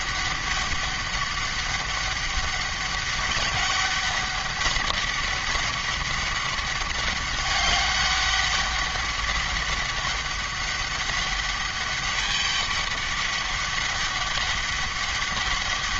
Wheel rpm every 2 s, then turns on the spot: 200, 190, 200, 200, 200, 200, 200, 200.
none